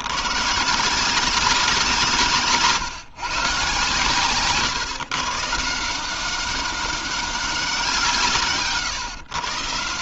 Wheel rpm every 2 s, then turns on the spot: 160, 140, 140, 200, 130.
none